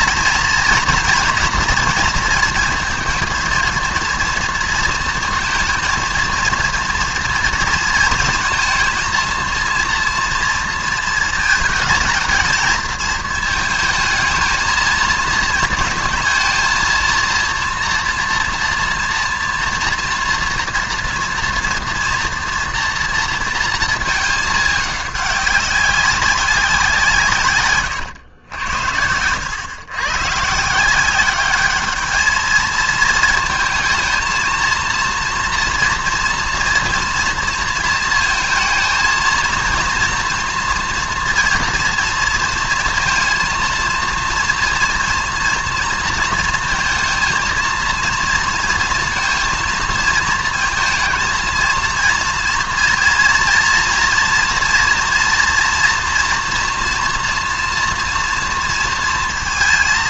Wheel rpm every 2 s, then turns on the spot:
230, 230, 230, 230, 230, 230, 220, 220, 230, 230, 240, 240, 210, 170, 90, 170, 220, 230, 240, 230, 230, 230, 230, 230, 230, 230, 230, 230, 230, 230.
none